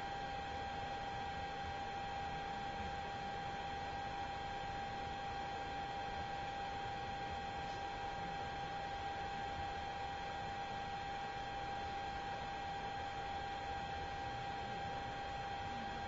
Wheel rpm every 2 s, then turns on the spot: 0, 0, 0, 0, 0, 0, 0, 0.
none